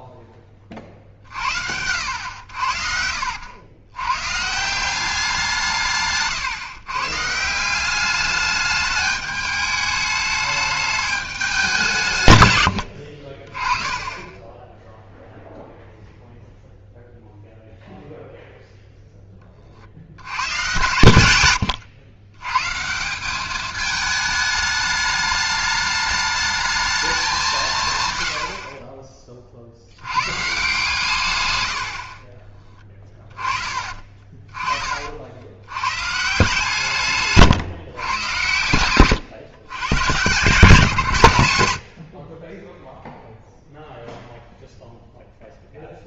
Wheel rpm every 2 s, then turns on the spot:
40, 70, 170, 130, 210, 210, 80, 10, 0, 0, 120, 150, 210, 220, 50, 140, 20, 30, 150, 100, 140, 0, 0.
2-4 12-14 20-22 32-34